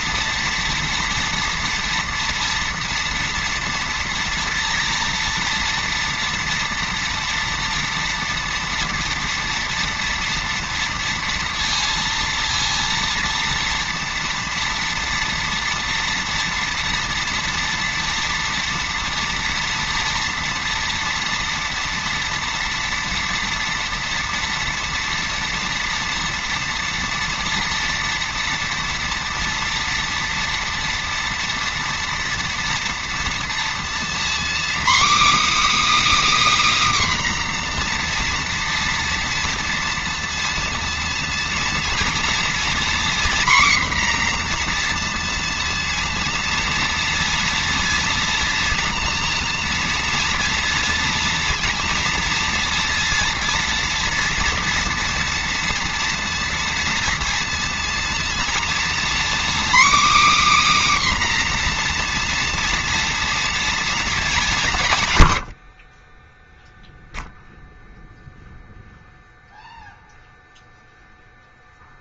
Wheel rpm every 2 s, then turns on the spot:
230, 240, 240, 230, 230, 230, 230, 230, 230, 230, 230, 230, 230, 230, 240, 230, 230, 260, 300, 240, 230, 240, 240, 230, 230, 230, 230, 240, 230, 230, 280, 240, 180, 0, 0, 0.
none